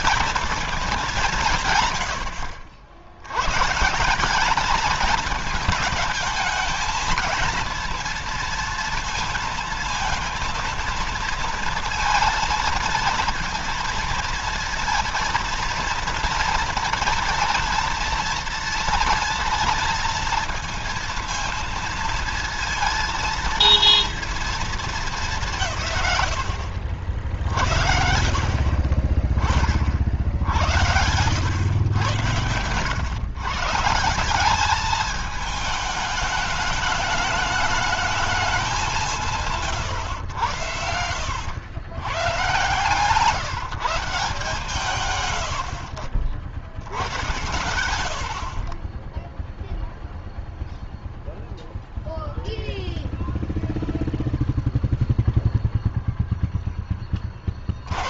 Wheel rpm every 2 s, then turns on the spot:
220, 90, 200, 220, 230, 230, 230, 230, 230, 230, 230, 230, 230, 80, 40, 70, 100, 200, 210, 210, 90, 130, 160, 90, 40, 0, 0, 0, 10.
none